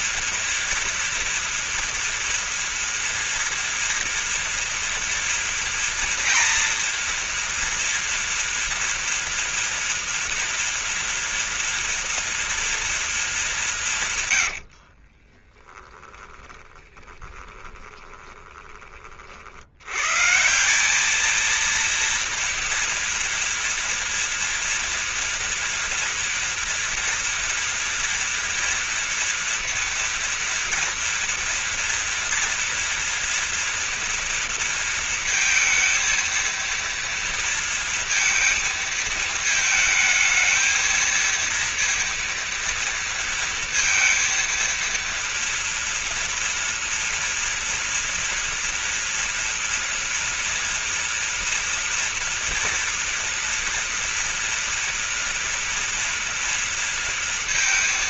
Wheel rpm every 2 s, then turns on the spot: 230, 240, 230, 230, 230, 230, 230, 70, 20, 20, 180, 230, 230, 230, 240, 230, 230, 230, 230, 220, 230, 230, 230, 230, 230, 230, 240, 230, 230.
14-18